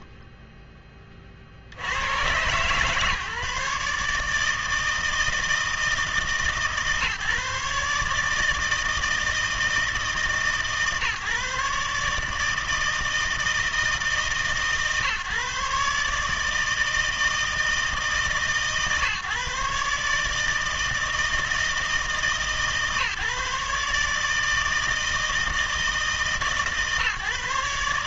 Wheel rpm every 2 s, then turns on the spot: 30, 140, 160, 140, 160, 150, 160, 150, 160, 150, 160, 150, 160, 150.
0-2